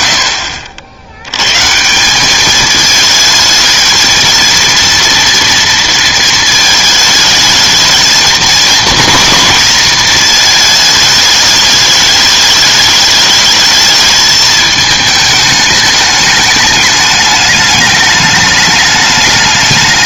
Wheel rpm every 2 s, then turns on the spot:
70, 210, 230, 220, 230, 220, 210, 220, 210, 210.
none